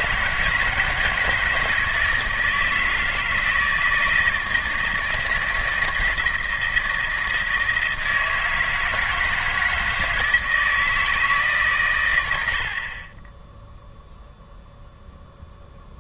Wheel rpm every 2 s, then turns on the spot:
160, 160, 160, 160, 160, 160, 60, 0.
none